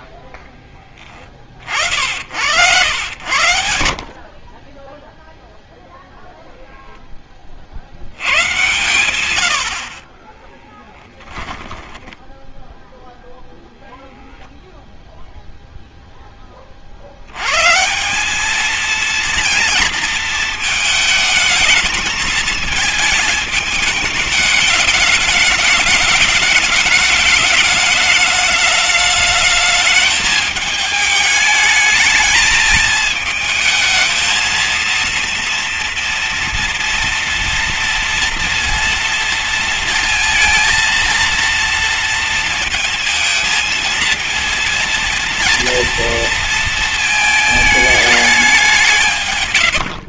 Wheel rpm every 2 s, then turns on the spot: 70, 60, 0, 10, 110, 10, 0, 0, 160, 230, 220, 220, 210, 210, 210, 210, 220, 230, 230, 230, 230, 220, 230, 220, 140.
10-12 48-50